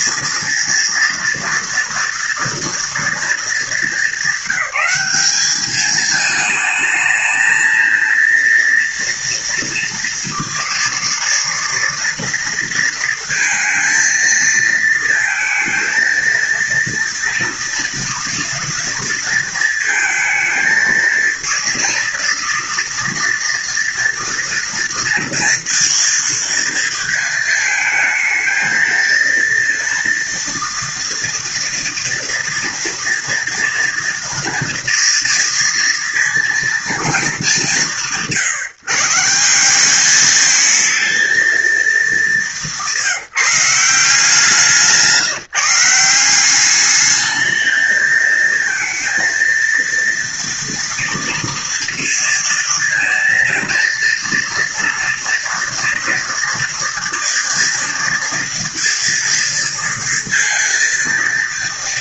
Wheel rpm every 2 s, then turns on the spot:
230, 230, 200, 220, 230, 230, 230, 230, 230, 230, 230, 230, 230, 230, 230, 230, 230, 240, 210, 160, 220, 170, 170, 200, 230, 230, 230, 230, 230, 230, 230.
none